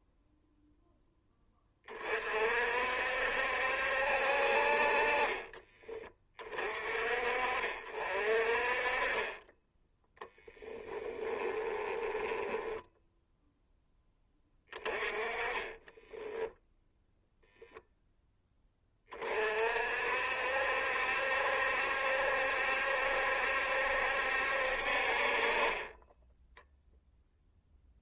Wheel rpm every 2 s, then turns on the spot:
0, 60, 40, 50, 30, 10, 10, 20, 0, 30, 70, 70, 50, 0.
10-16